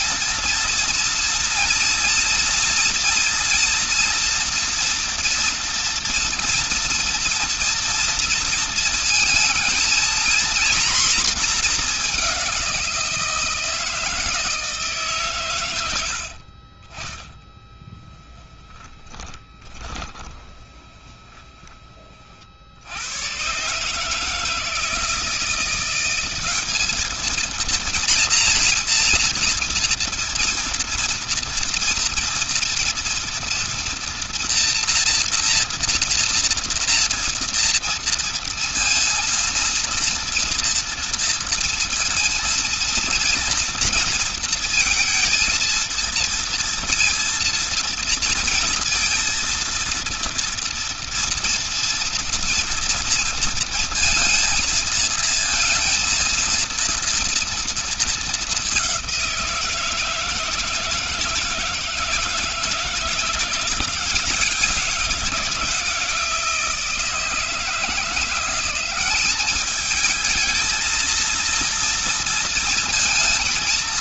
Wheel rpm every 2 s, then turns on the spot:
230, 230, 230, 230, 230, 230, 190, 160, 60, 10, 20, 50, 160, 190, 230, 230, 230, 240, 230, 230, 230, 230, 230, 230, 230, 230, 230, 230, 230, 210, 160, 160, 180, 170, 180, 220, 230.
16-22